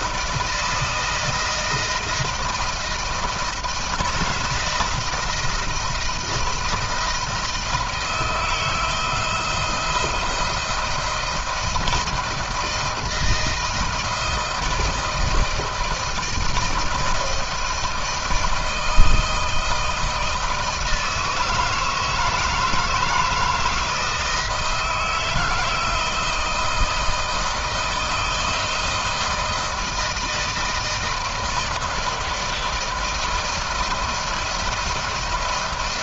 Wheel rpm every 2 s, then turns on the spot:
160, 160, 160, 170, 160, 160, 160, 160, 160, 160, 160, 160, 160, 160, 160, 160, 160, 170.
none